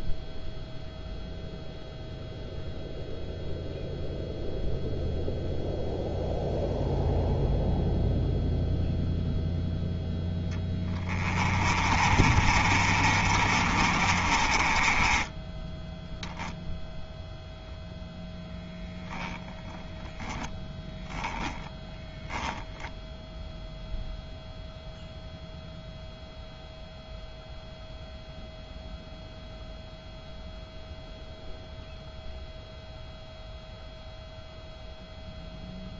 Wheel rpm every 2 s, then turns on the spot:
0, 0, 0, 0, 0, 10, 40, 20, 0, 0, 10, 0, 0, 0, 0, 0, 0, 0.
10-16